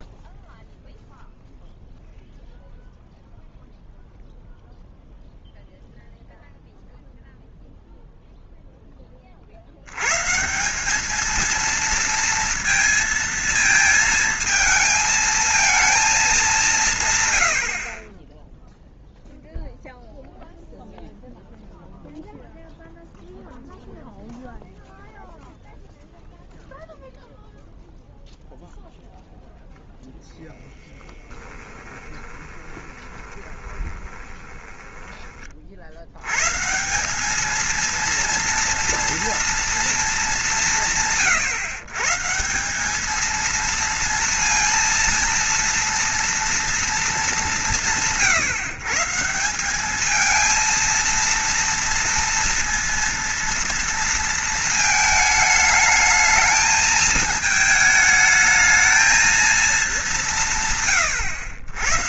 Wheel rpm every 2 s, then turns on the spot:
0, 0, 0, 0, 0, 180, 230, 220, 170, 0, 0, 0, 0, 0, 0, 0, 20, 20, 150, 230, 180, 180, 230, 230, 140, 230, 230, 220, 220, 220, 140.
32-36